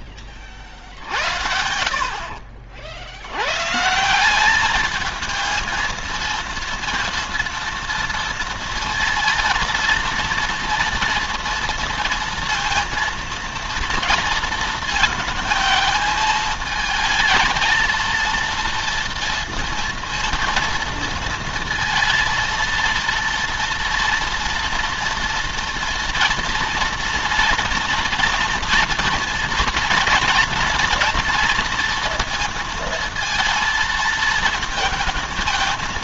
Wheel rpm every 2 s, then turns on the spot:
50, 60, 210, 230, 230, 230, 230, 230, 220, 230, 230, 230, 230, 230, 230, 230, 230, 220.
none